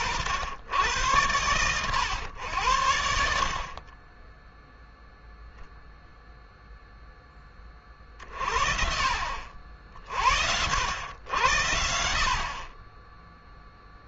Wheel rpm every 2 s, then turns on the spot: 100, 80, 0, 0, 50, 90, 30.
none